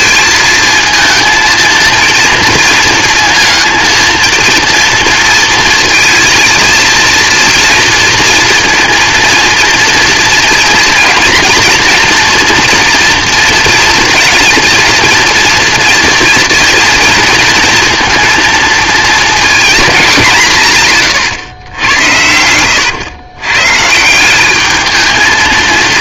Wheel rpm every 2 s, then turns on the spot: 230, 230, 240, 230, 230, 240, 230, 230, 230, 230, 150, 100, 210.
none